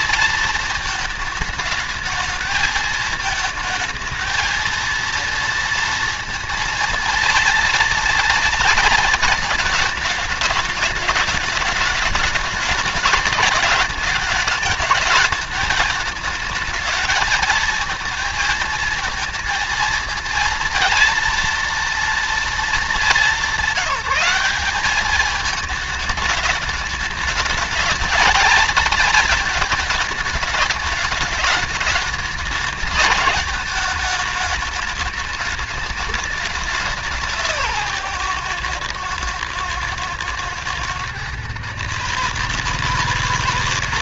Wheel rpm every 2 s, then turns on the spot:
220, 220, 220, 230, 230, 210, 220, 220, 220, 220, 230, 230, 200, 210, 220, 210, 210, 210, 200, 130, 120, 150.
none